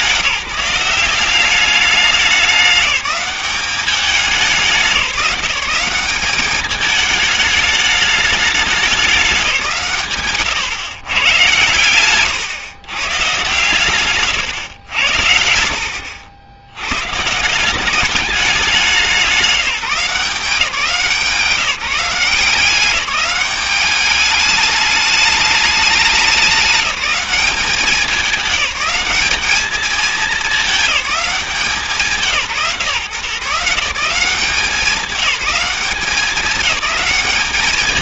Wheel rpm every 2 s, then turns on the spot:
180, 200, 190, 200, 200, 130, 120, 110, 90, 190, 170, 180, 210, 200, 200, 210, 150, 190, 190.
none